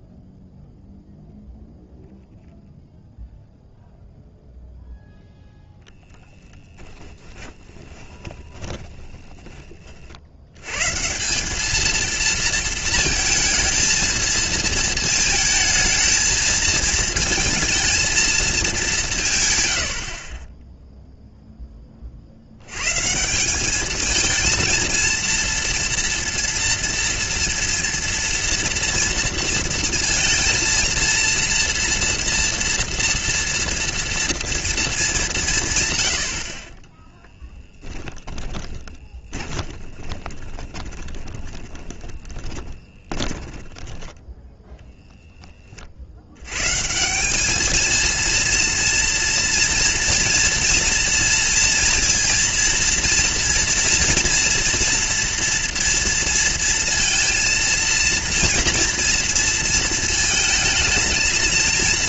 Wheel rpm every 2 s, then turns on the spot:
0, 0, 0, 20, 20, 90, 230, 220, 220, 210, 20, 90, 220, 230, 230, 230, 230, 230, 50, 20, 20, 20, 0, 110, 230, 230, 230, 230, 230, 230, 220.
6-10 38-44